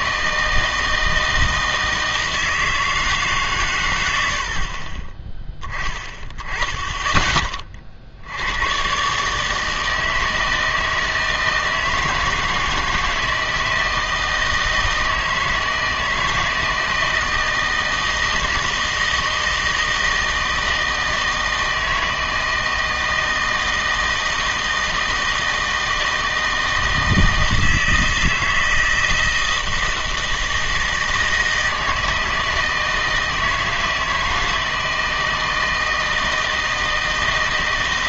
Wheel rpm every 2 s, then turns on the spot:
160, 160, 60, 20, 100, 160, 160, 160, 160, 160, 160, 160, 160, 160, 160, 160, 160, 160, 160.
none